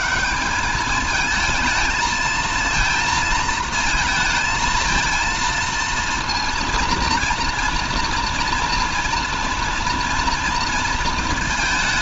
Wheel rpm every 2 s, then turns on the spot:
210, 220, 220, 230, 240, 230.
none